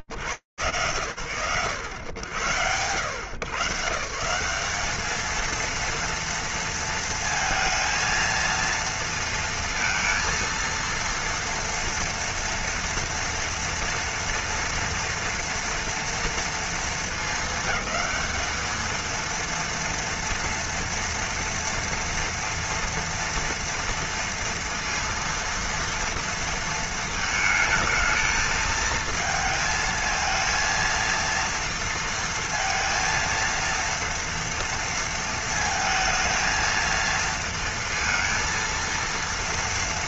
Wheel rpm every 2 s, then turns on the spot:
90, 190, 230, 230, 230, 230, 230, 230, 220, 230, 230, 240, 230, 220, 220, 230, 230, 230, 230, 230.
none